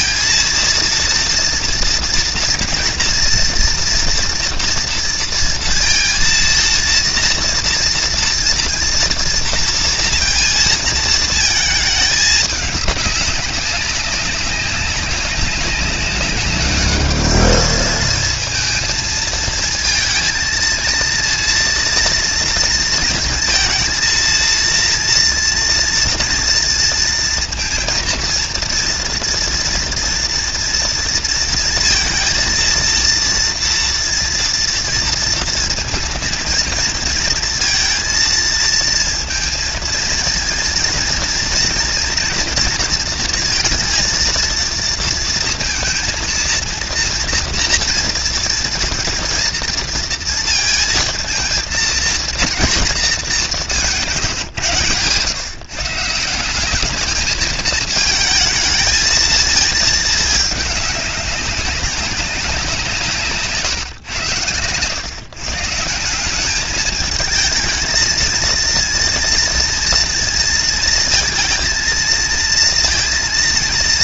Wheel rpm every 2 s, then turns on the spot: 230, 230, 230, 230, 230, 220, 200, 190, 210, 230, 230, 220, 230, 230, 230, 230, 230, 230, 230, 230, 240, 230, 230, 230, 230, 230, 230, 130, 200, 220, 210, 180, 110, 210, 230, 230, 230.
none